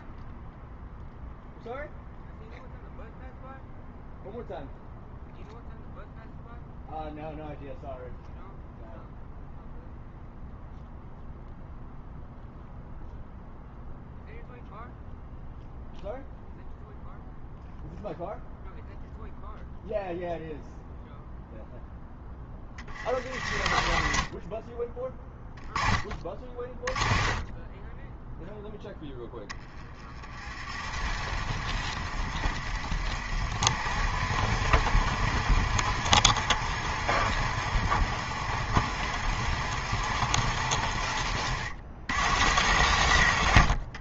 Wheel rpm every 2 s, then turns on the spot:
0, 0, 0, 0, 0, 0, 0, 0, 0, 0, 0, 10, 40, 20, 0, 30, 60, 80, 90, 80, 80, 100.
22-28 30-44